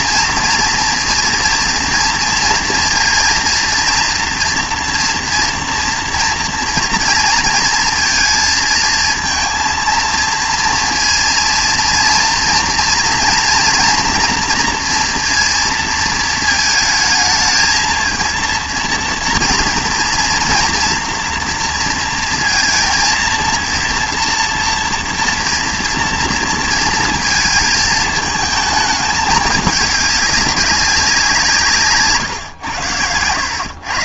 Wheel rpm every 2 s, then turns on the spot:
230, 230, 240, 240, 230, 230, 230, 240, 220, 230, 230, 230, 230, 230, 220, 200, 120.
none